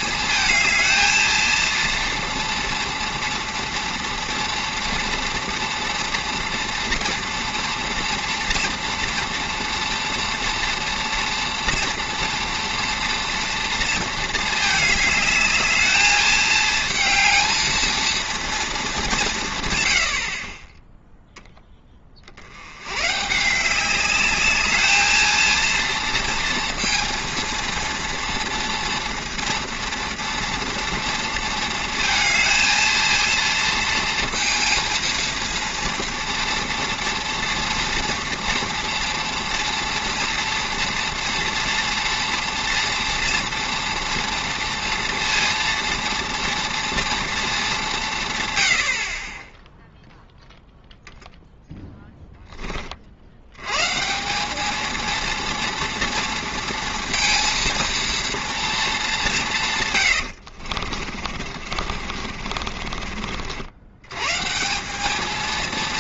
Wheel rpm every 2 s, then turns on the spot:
220, 240, 230, 240, 240, 230, 230, 220, 220, 220, 30, 90, 210, 230, 230, 230, 230, 230, 230, 230, 230, 230, 230, 230, 100, 0, 20, 200, 230, 220, 70, 40, 160.
60-64